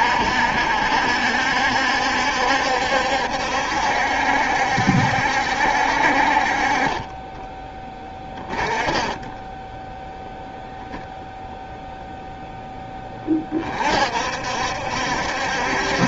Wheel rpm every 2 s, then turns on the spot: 70, 70, 70, 40, 20, 0, 10, 70.
8-10